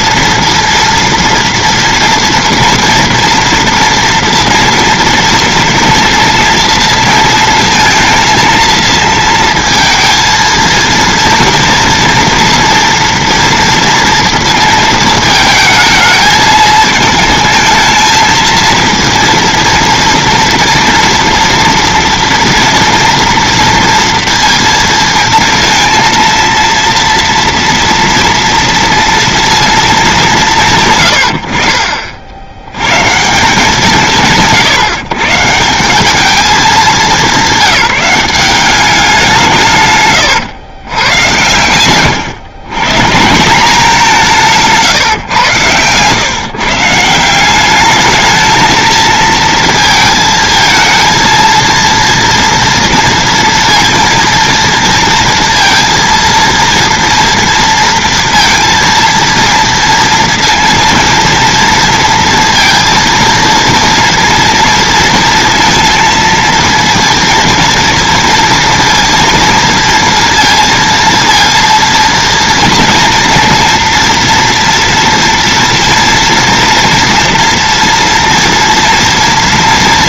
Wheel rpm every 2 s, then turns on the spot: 230, 230, 230, 230, 230, 230, 230, 230, 220, 230, 230, 230, 230, 230, 230, 160, 90, 150, 210, 190, 120, 130, 150, 150, 220, 220, 230, 230, 230, 230, 230, 230, 230, 230, 230, 230, 230, 230, 240, 230.
none